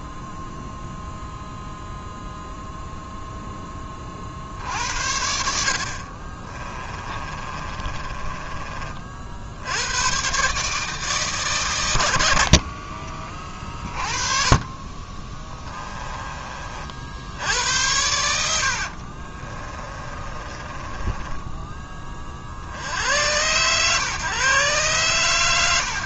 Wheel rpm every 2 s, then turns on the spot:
0, 0, 70, 30, 40, 150, 50, 40, 60, 60, 20, 80, 120.
6-8 18-22